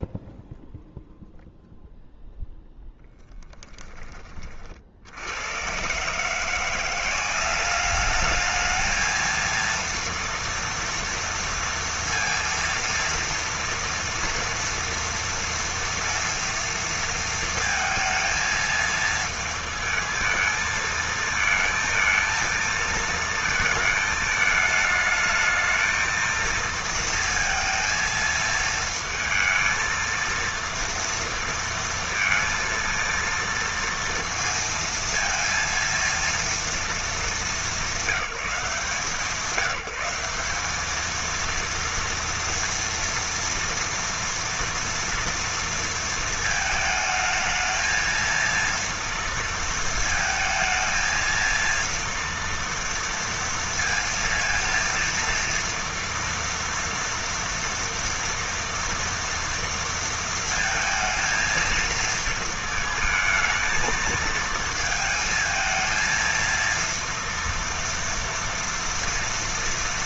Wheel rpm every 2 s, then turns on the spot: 0, 0, 70, 180, 220, 230, 230, 230, 230, 220, 220, 230, 220, 230, 230, 230, 230, 230, 210, 170, 220, 230, 230, 220, 230, 220, 230, 230, 230, 230, 220, 220, 220, 230, 230.
none